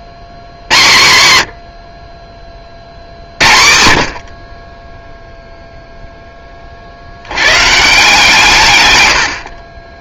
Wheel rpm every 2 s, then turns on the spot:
80, 40, 30, 40, 130.
none